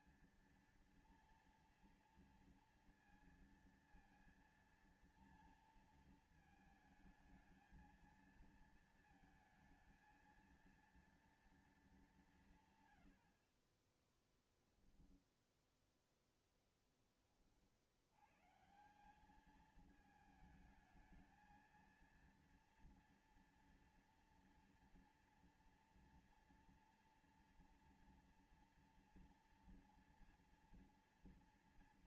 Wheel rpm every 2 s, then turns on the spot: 230, 230, 230, 230, 220, 230, 230, 50, 0, 40, 200, 220, 230, 230, 230, 230.
14-16